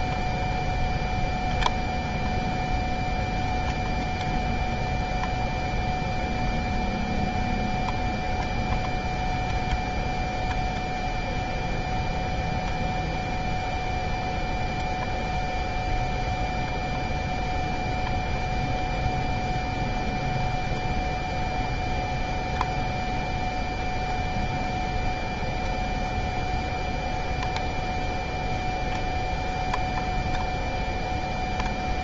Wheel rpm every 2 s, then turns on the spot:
0, 0, 0, 0, 0, 0, 0, 0, 0, 0, 0, 0, 0, 0, 0, 0.
none